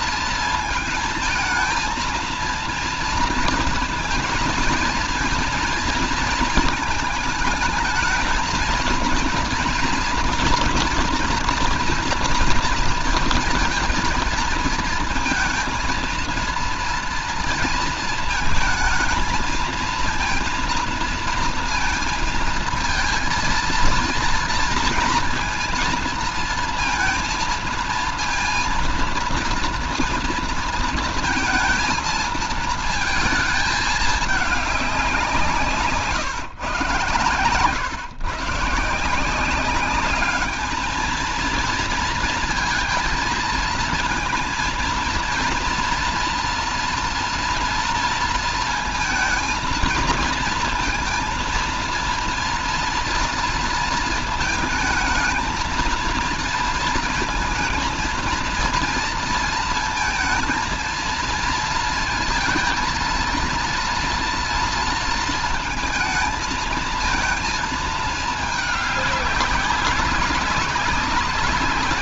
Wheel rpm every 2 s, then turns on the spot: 220, 230, 230, 230, 230, 230, 230, 230, 230, 230, 230, 230, 230, 230, 230, 230, 220, 210, 130, 130, 210, 230, 230, 230, 230, 230, 230, 220, 230, 230, 230, 220, 230, 230, 210, 200.
none